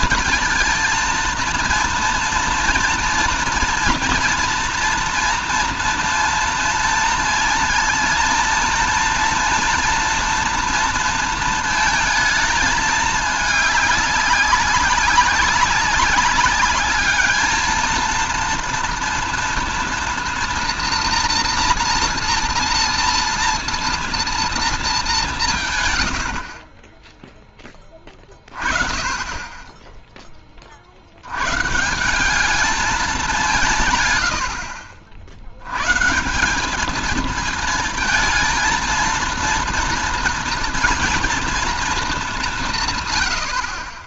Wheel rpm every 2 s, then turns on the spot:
230, 230, 240, 230, 230, 230, 220, 200, 200, 230, 240, 240, 230, 60, 40, 30, 200, 80, 180, 220, 230, 190.
none